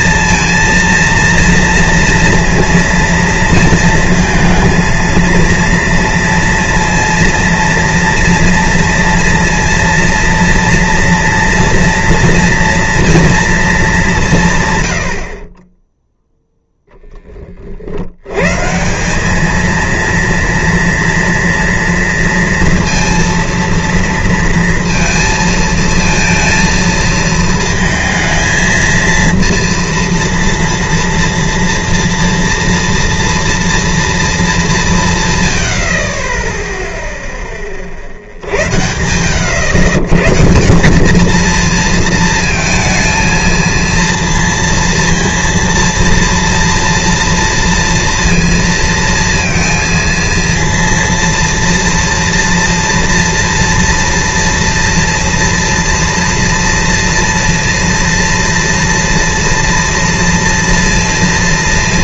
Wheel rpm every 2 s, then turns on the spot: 230, 230, 220, 230, 230, 230, 230, 140, 10, 150, 230, 230, 230, 230, 230, 230, 230, 200, 10, 70, 160, 220, 230, 230, 230, 230, 240, 230, 230, 230, 230.
none